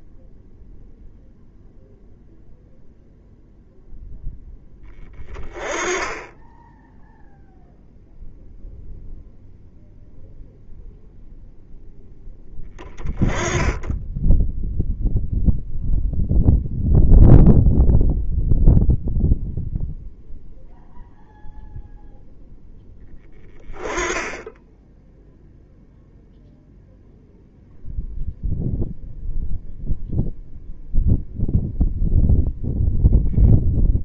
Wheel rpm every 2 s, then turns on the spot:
0, 0, 10, 10, 0, 0, 10, 0, 0, 0, 0, 0, 0, 0, 0, 0, 0.
none